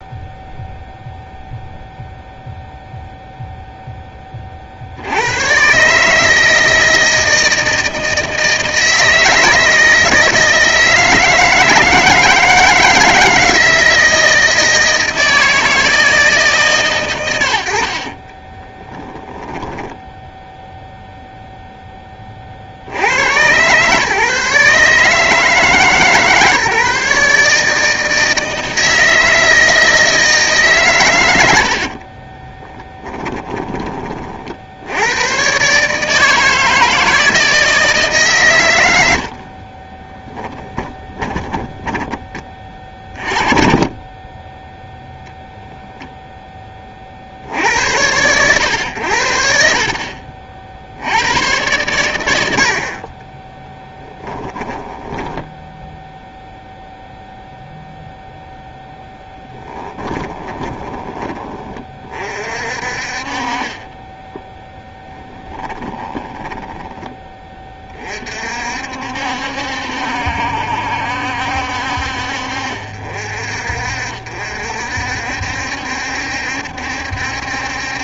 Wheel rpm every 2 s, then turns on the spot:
0, 0, 80, 160, 160, 160, 170, 160, 110, 10, 0, 80, 150, 150, 160, 120, 10, 80, 160, 80, 20, 30, 0, 40, 90, 90, 50, 10, 0, 0, 20, 50, 10, 20, 60, 70, 50, 60, 70.
18-20 32-34 40-42 54-56 66-68